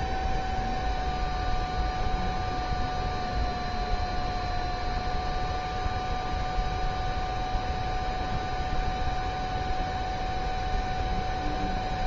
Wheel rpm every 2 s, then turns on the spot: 0, 0, 0, 0, 0, 0.
none